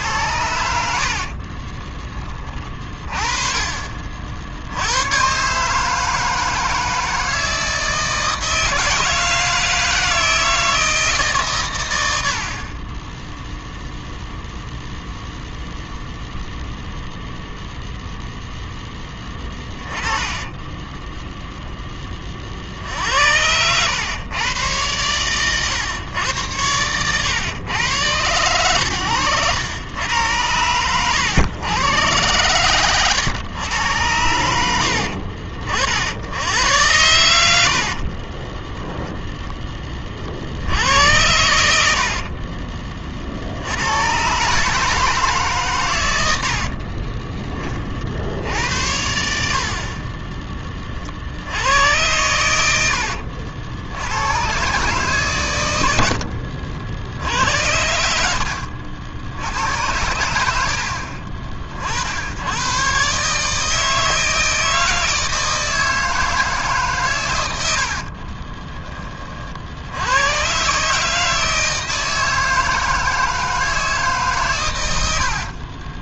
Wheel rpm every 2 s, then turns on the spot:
70, 30, 80, 160, 160, 160, 50, 0, 0, 0, 20, 50, 110, 110, 110, 90, 110, 80, 90, 10, 60, 40, 150, 70, 80, 30, 80, 130, 60, 60, 90, 110, 160, 150, 30, 130, 160, 120.
20-22 38-40 42-44 46-48 68-70